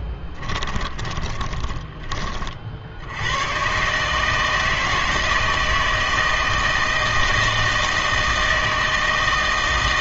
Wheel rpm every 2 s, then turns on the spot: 20, 50, 160, 160, 160.
0-2